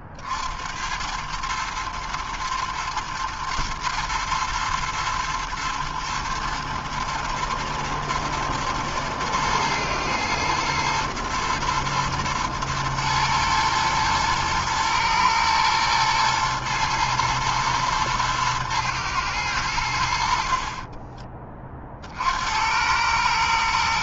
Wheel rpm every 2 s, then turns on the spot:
60, 110, 110, 110, 110, 110, 110, 120, 110, 120, 60, 70.
none